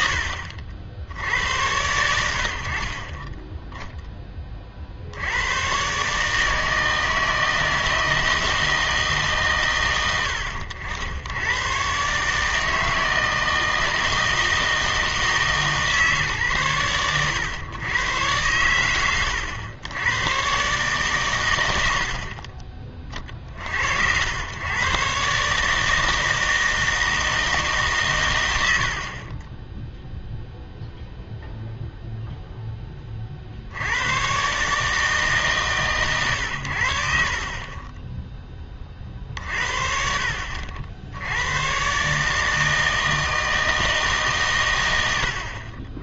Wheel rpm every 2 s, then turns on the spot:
80, 50, 40, 160, 160, 80, 160, 160, 120, 110, 130, 40, 110, 160, 90, 0, 10, 140, 80, 20, 60, 160, 120.
none